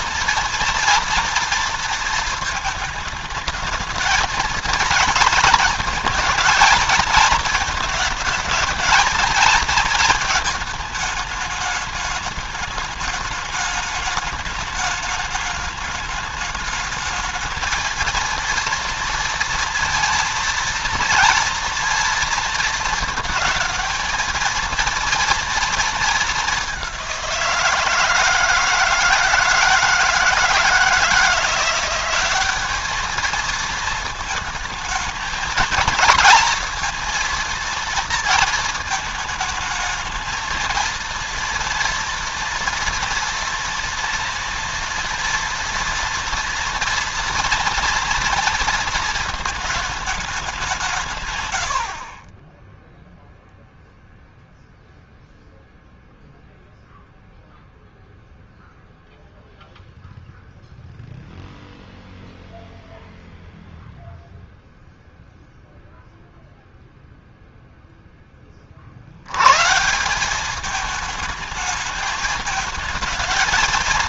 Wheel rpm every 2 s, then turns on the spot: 230, 220, 230, 220, 220, 220, 210, 210, 210, 230, 230, 220, 230, 190, 160, 160, 210, 220, 230, 220, 230, 230, 230, 240, 230, 170, 0, 0, 0, 0, 0, 0, 0, 0, 60, 210, 220.
none